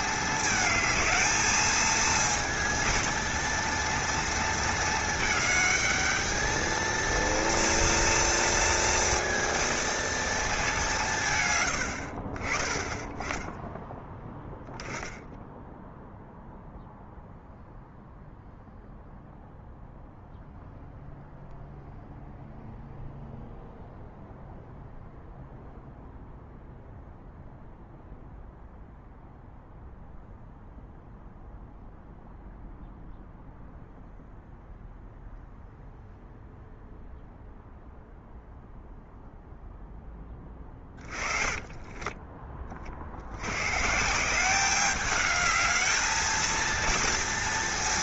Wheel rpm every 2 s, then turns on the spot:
220, 230, 220, 220, 230, 200, 20, 10, 0, 0, 0, 0, 0, 0, 0, 0, 0, 0, 0, 0, 20, 30, 200, 230.
40-42